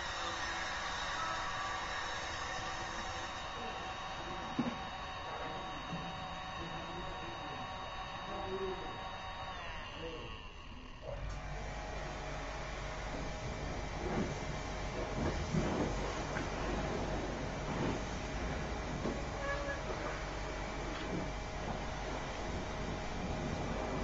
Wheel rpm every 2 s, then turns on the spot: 0, 0, 0, 0, 0, 0, 0, 0, 0, 0, 0, 0.
none